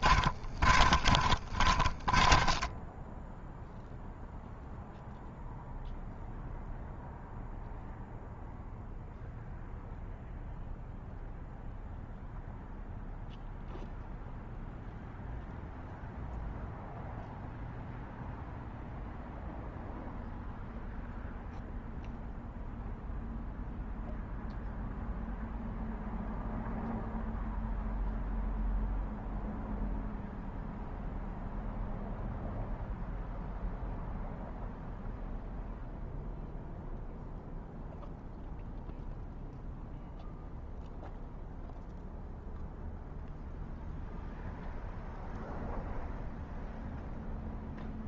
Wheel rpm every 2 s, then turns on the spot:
40, 10, 0, 0, 0, 0, 0, 0, 0, 0, 0, 0, 0, 0, 0, 0, 0, 0, 0, 0, 0, 0, 0, 0.
0-4